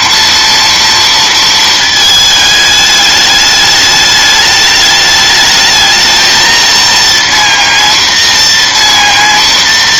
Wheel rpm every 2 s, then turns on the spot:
230, 210, 210, 230, 230.
none